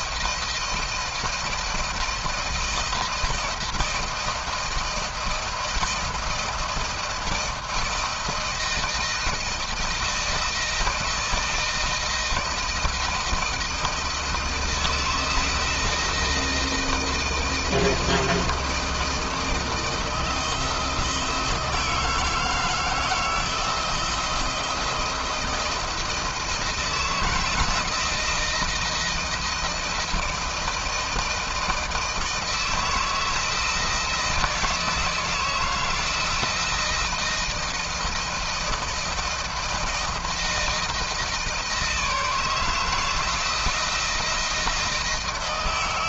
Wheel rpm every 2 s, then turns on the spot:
170, 160, 160, 170, 160, 160, 170, 160, 160, 160, 160, 160, 170, 160, 170, 170, 160, 160, 170, 160, 170, 160, 160.
none